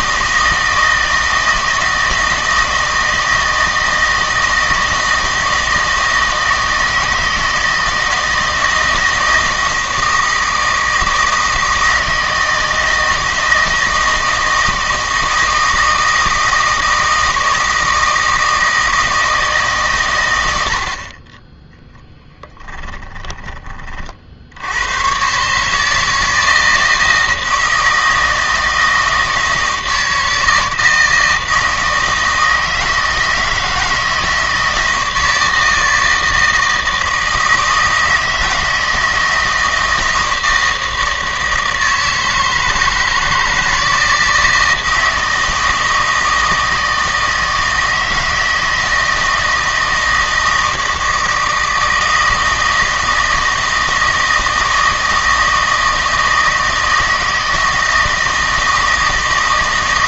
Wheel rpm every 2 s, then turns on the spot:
160, 160, 160, 160, 160, 160, 160, 160, 160, 160, 80, 10, 80, 160, 160, 160, 160, 160, 160, 160, 160, 160, 160, 160, 160, 160, 160, 160, 160, 160.
22-24